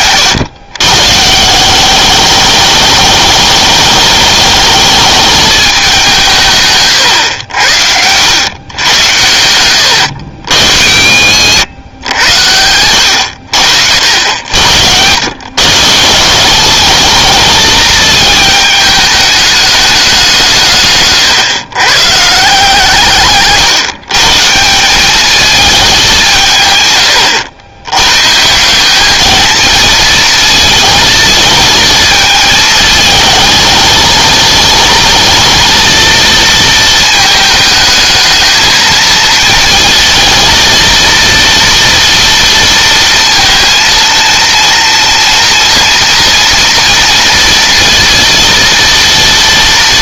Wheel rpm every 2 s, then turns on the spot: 130, 210, 210, 130, 100, 70, 80, 80, 200, 210, 130, 150, 200, 110, 210, 230, 220, 220, 220, 220, 230, 230, 230, 230, 230.
10-12